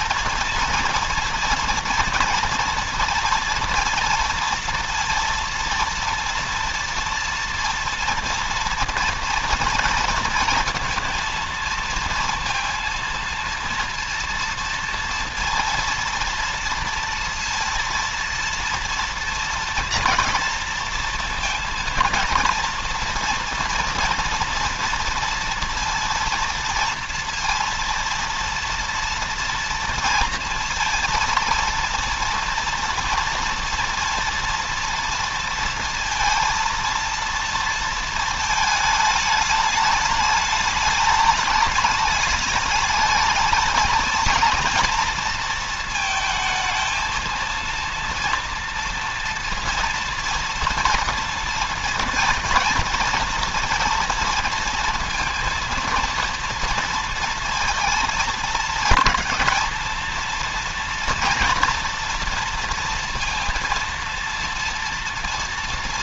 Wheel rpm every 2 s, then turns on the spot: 230, 230, 230, 230, 230, 230, 230, 230, 230, 230, 230, 230, 230, 230, 230, 230, 230, 230, 230, 220, 210, 210, 230, 220, 230, 230, 230, 230, 230, 230, 240, 230, 230.
none